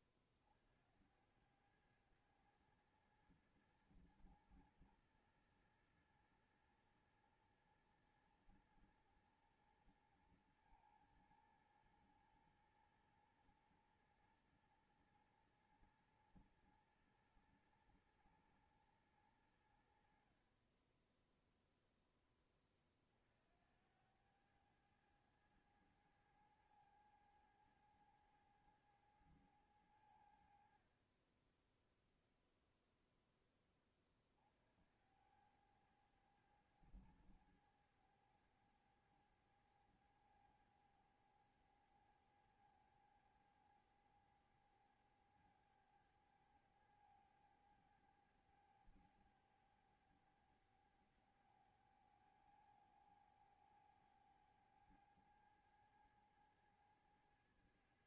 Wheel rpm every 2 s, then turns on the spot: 50, 110, 110, 110, 120, 120, 110, 110, 110, 110, 60, 10, 90, 110, 110, 80, 0, 40, 100, 100, 100, 100, 100, 100, 100, 100, 100, 100, 110.
none